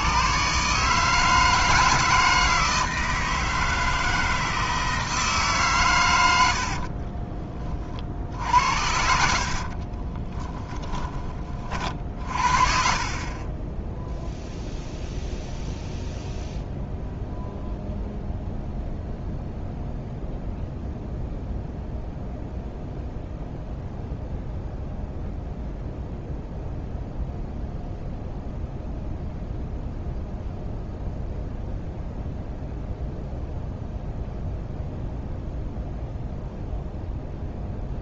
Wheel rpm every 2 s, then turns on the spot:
150, 160, 160, 50, 60, 20, 50, 0, 0, 0, 0, 0, 0, 0, 0, 0, 0, 0, 0.
6-8